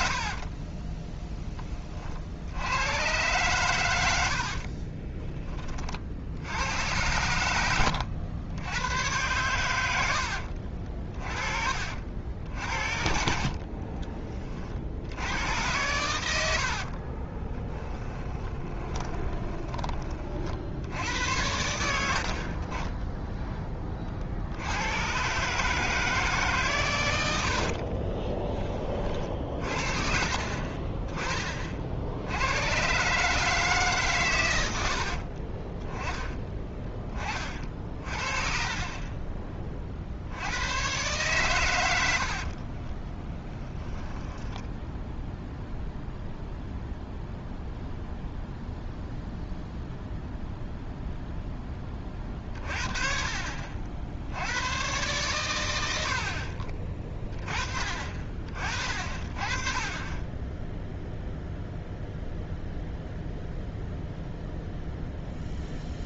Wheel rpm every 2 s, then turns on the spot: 40, 100, 40, 80, 100, 50, 60, 40, 70, 20, 60, 30, 80, 130, 30, 30, 110, 100, 20, 40, 100, 40, 0, 0, 0, 0, 40, 100, 50, 40, 10, 0, 0.
0-2 4-6 10-12 16-20 36-40 42-44